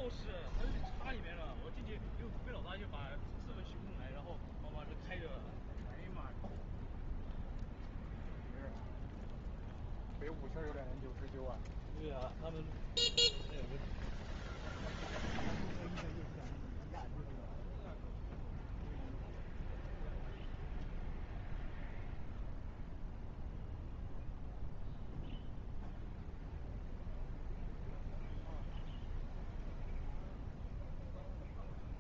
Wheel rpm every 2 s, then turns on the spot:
0, 0, 0, 0, 0, 0, 0, 0, 0, 0, 0, 0, 0, 0, 0, 0.
none